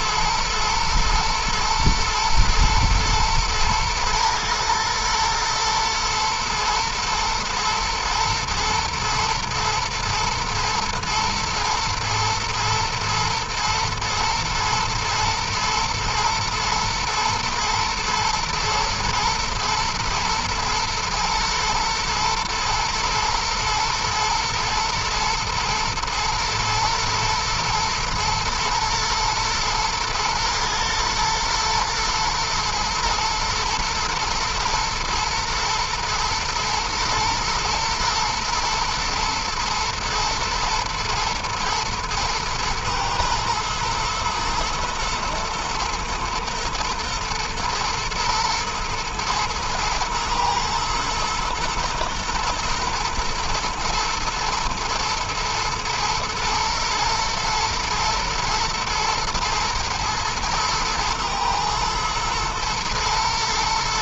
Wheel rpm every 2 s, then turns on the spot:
120, 110, 110, 110, 110, 120, 120, 120, 120, 110, 110, 110, 120, 120, 120, 110, 120, 120, 120, 120, 110, 110, 110, 120, 120, 110, 120, 120, 110, 110, 110, 110.
none